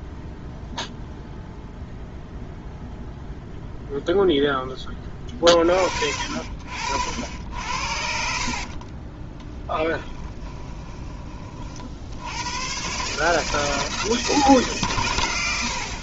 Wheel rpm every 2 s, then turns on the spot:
0, 0, 10, 60, 40, 20, 110, 140.
8-12